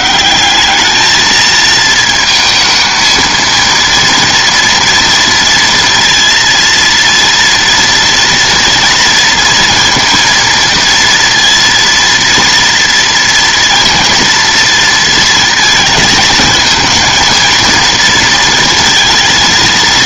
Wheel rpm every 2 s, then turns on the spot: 200, 230, 230, 230, 230, 230, 230, 230, 220, 230.
none